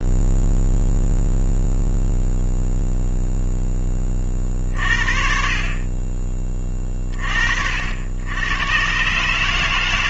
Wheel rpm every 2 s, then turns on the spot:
0, 0, 40, 30, 100.
none